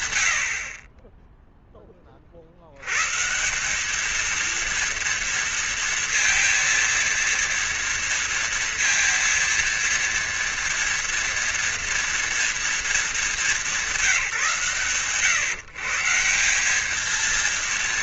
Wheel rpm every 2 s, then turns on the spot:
30, 220, 230, 230, 230, 230, 180, 160, 230.
none